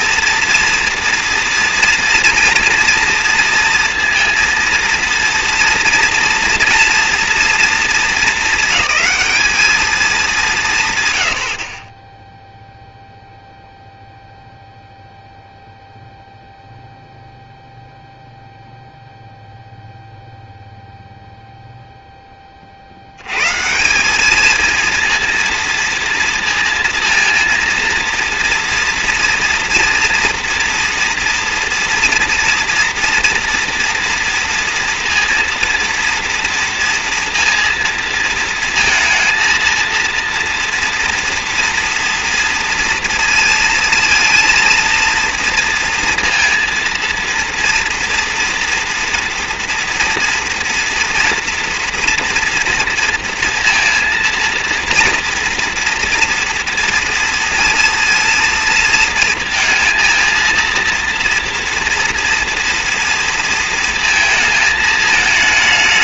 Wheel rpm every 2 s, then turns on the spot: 230, 230, 230, 240, 210, 180, 0, 0, 0, 0, 0, 10, 210, 230, 230, 230, 230, 230, 230, 230, 230, 230, 230, 230, 230, 230, 230, 230, 230, 230, 230, 240, 220.
none